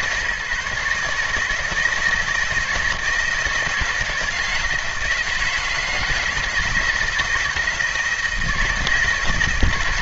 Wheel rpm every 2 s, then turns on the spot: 150, 160, 160, 160, 150.
none